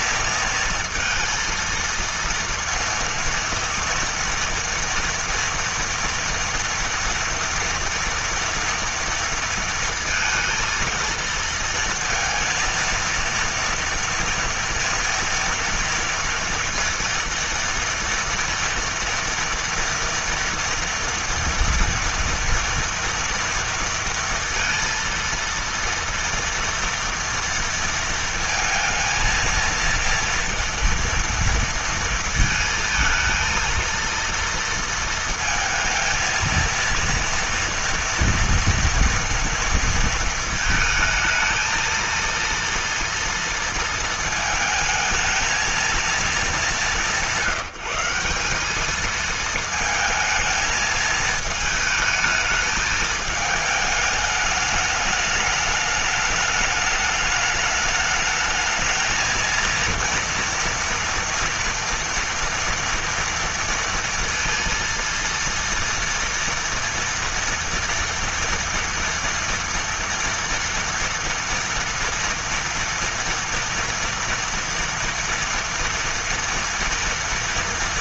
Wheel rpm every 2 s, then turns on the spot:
230, 230, 240, 230, 230, 230, 230, 230, 230, 230, 230, 230, 230, 230, 230, 230, 220, 230, 230, 230, 230, 230, 220, 200, 200, 220, 220, 210, 210, 220, 230, 230, 230, 230, 230, 230, 230, 230, 230.
none